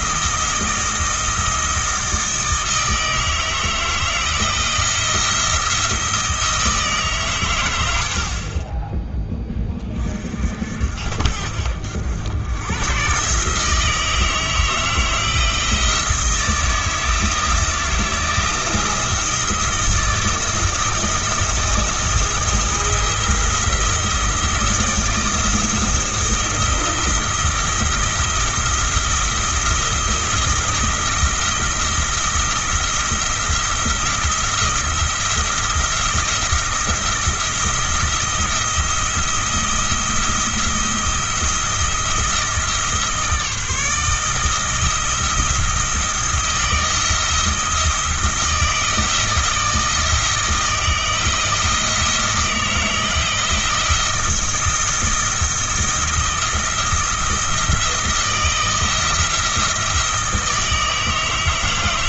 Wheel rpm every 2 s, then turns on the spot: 160, 160, 160, 160, 30, 50, 110, 160, 160, 160, 170, 170, 170, 170, 170, 170, 170, 170, 170, 170, 170, 160, 160, 170, 160, 160, 160, 160, 170, 170, 160.
none